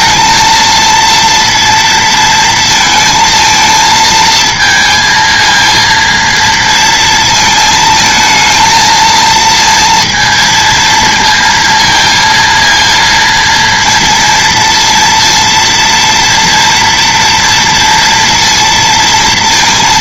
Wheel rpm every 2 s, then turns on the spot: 230, 230, 220, 230, 220, 230, 230, 230, 230, 230.
none